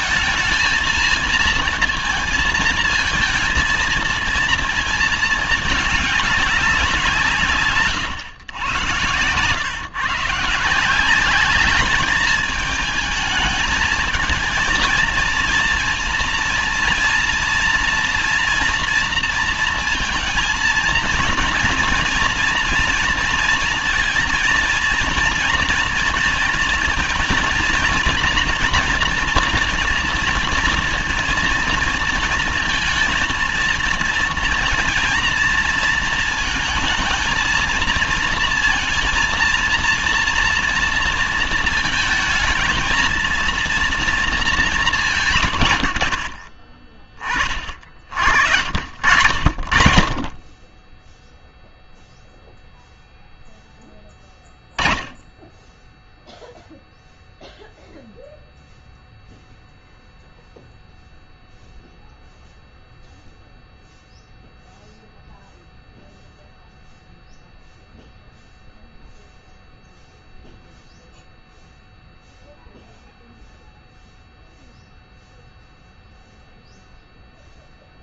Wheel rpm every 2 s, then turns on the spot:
220, 220, 230, 190, 120, 170, 220, 230, 230, 230, 220, 230, 230, 230, 230, 230, 220, 230, 220, 230, 230, 230, 200, 40, 70, 20, 0, 20, 0, 0, 0, 0, 0, 0, 0, 0, 0, 0, 0.
none